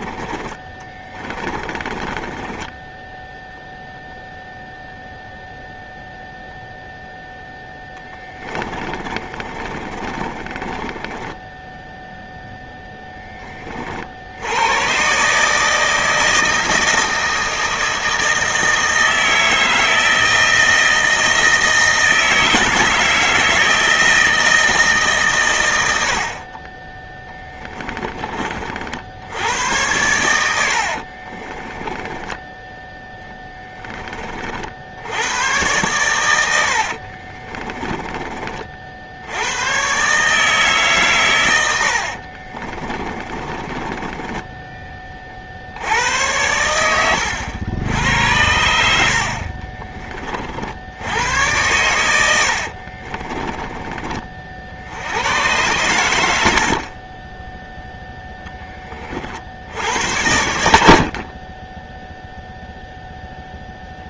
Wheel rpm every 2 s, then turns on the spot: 20, 0, 0, 0, 20, 10, 10, 130, 160, 160, 160, 160, 130, 20, 70, 60, 10, 60, 80, 40, 140, 40, 20, 80, 90, 40, 90, 30, 100, 0, 70, 20.
0-2 8-10 26-28 30-32 36-38 42-46 52-54